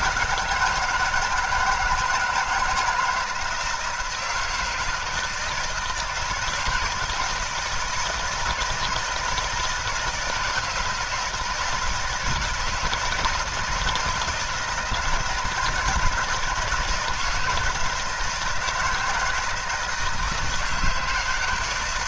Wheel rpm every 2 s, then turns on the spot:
160, 160, 160, 160, 160, 160, 160, 170, 170, 160, 160.
none